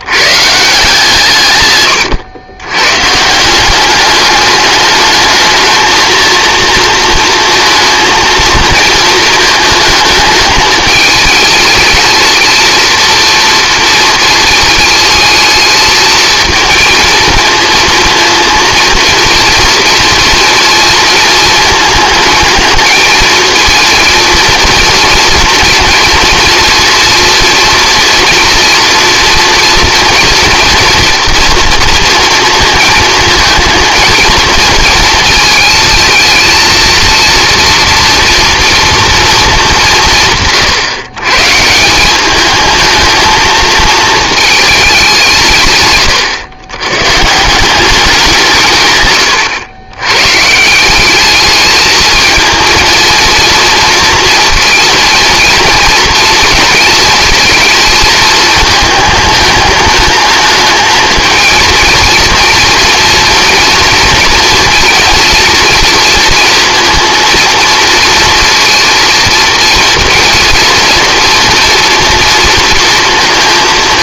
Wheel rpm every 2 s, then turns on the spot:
150, 120, 210, 230, 230, 220, 230, 220, 230, 230, 230, 220, 230, 240, 230, 230, 230, 230, 220, 230, 150, 220, 220, 120, 150, 160, 230, 230, 230, 220, 220, 230, 230, 230, 230, 230, 230.
none